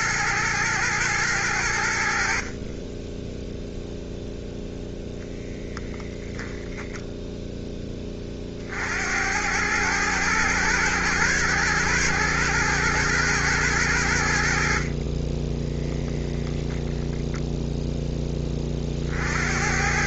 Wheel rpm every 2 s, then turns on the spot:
110, 40, 0, 0, 50, 110, 110, 70, 10, 30.
16-18